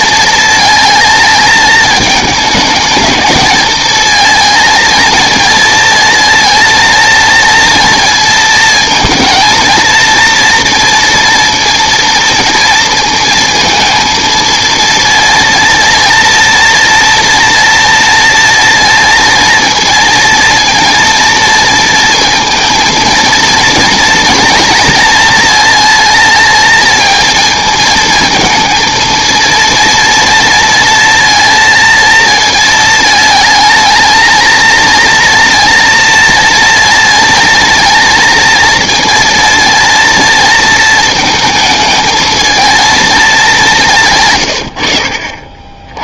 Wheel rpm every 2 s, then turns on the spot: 230, 210, 230, 230, 230, 230, 230, 220, 230, 230, 230, 230, 230, 230, 230, 230, 220, 220, 230, 230, 230, 220, 140.
44-46